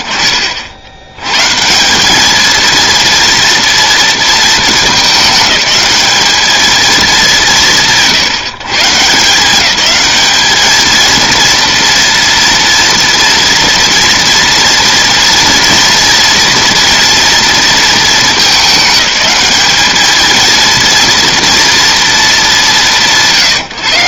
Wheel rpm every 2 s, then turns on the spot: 60, 230, 210, 190, 160, 220, 230, 230, 230, 210, 230, 160.
none